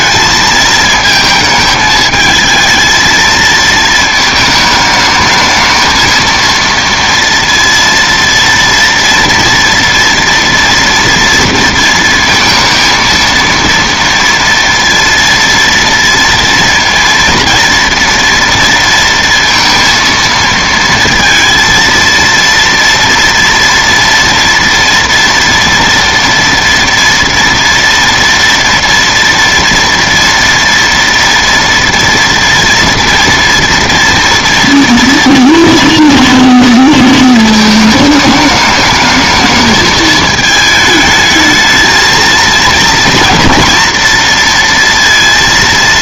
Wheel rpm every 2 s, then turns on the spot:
220, 220, 220, 230, 230, 230, 230, 230, 230, 230, 230, 230, 230, 230, 230, 230, 230, 230, 230, 210, 220, 230, 230.
none